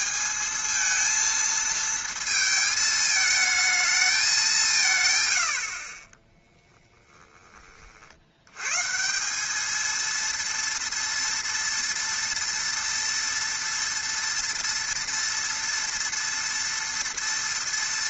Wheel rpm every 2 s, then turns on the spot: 220, 220, 160, 10, 160, 230, 230, 230, 230.
none